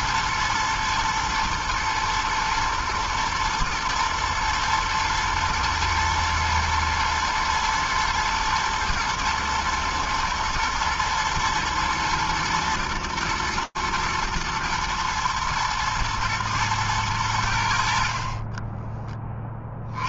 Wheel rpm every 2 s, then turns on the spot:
120, 110, 110, 120, 110, 110, 110, 110, 110, 30.
none